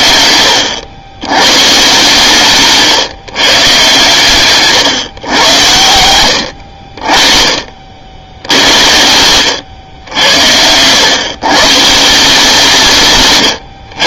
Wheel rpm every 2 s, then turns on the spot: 90, 140, 130, 80, 80, 90, 160.
none